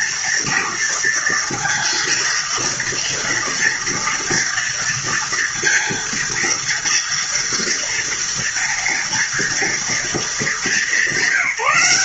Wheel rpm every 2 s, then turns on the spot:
230, 230, 230, 230, 230, 210.
none